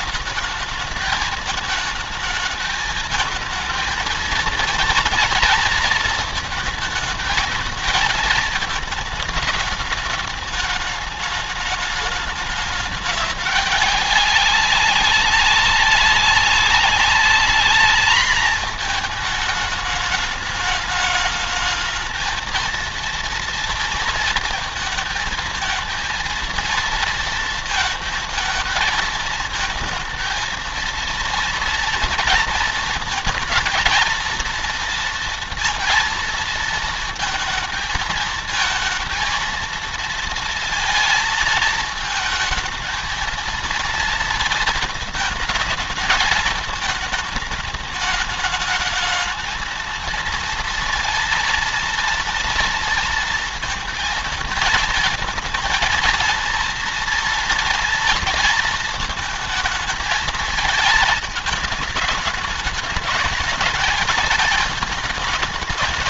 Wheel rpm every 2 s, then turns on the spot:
210, 220, 230, 220, 220, 210, 210, 190, 190, 210, 210, 230, 220, 230, 220, 230, 220, 230, 230, 230, 230, 220, 220, 220, 220, 230, 230, 220, 230, 220, 220, 220, 210.
none